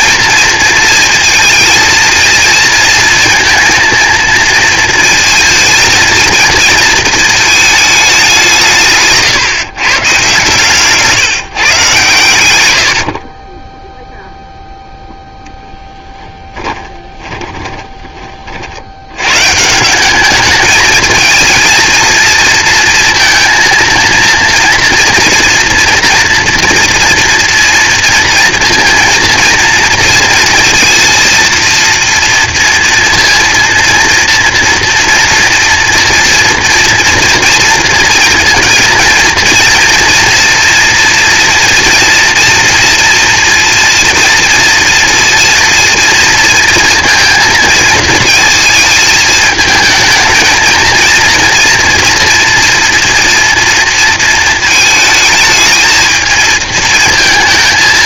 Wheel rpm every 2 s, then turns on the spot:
230, 230, 230, 230, 190, 130, 110, 0, 10, 70, 220, 230, 230, 230, 230, 230, 230, 230, 230, 230, 240, 230, 230, 230, 220, 230, 240, 220, 220.
16-18